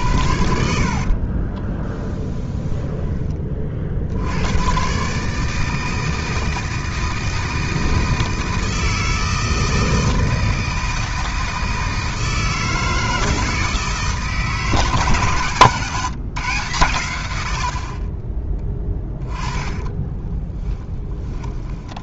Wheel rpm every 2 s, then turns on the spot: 60, 10, 130, 160, 160, 160, 160, 140, 110, 10, 10.
0-2 18-20